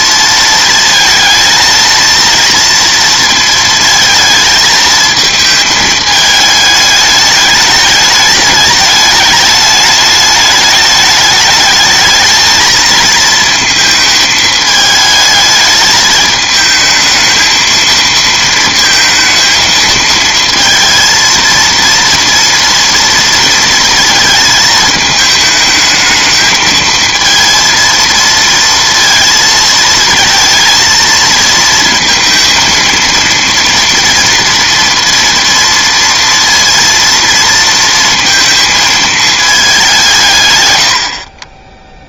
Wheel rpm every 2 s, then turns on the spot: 230, 230, 220, 220, 210, 210, 220, 220, 220, 230, 230, 230, 220, 220, 230, 220, 230, 230, 230, 220, 110.
none